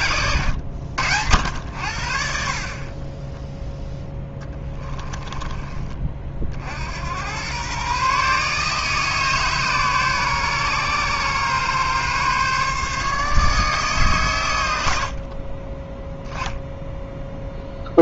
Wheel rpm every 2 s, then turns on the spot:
90, 40, 10, 60, 150, 140, 140, 100, 0.
4-6